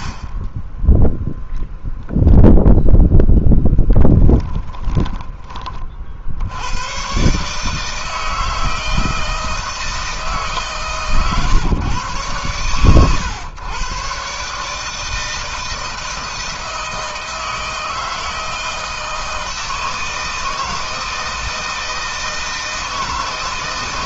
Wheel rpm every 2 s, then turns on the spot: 10, 0, 10, 110, 160, 140, 120, 150, 160, 160, 160, 160.
none